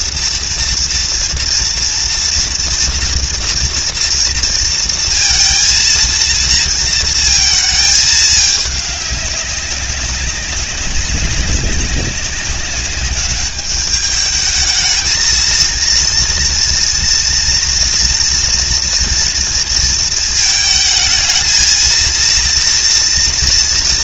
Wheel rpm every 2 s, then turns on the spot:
230, 230, 230, 230, 200, 190, 200, 220, 230, 240, 220, 230.
none